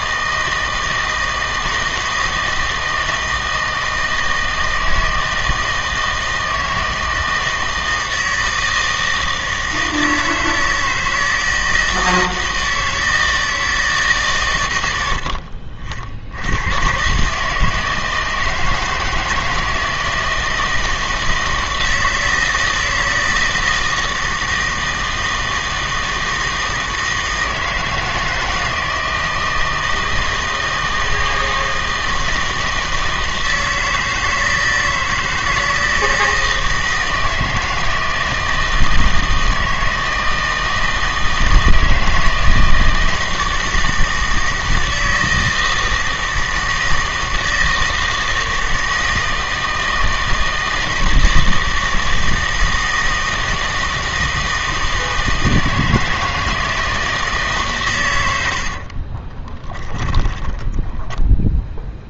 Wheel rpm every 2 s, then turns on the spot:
160, 160, 160, 160, 160, 160, 160, 110, 100, 160, 160, 160, 160, 160, 160, 160, 160, 160, 160, 160, 160, 160, 160, 160, 160, 160, 160, 160, 160, 70, 10.
58-62